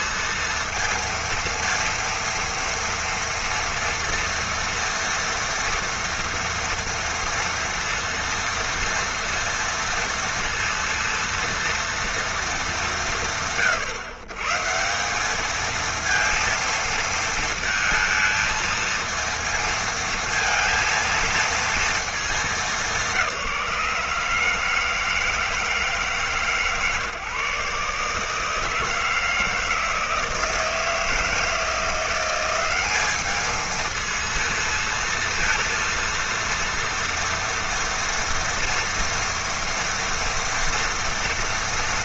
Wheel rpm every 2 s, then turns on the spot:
230, 230, 230, 230, 230, 230, 210, 140, 230, 220, 230, 200, 160, 140, 160, 160, 190, 230, 230, 230, 230.
none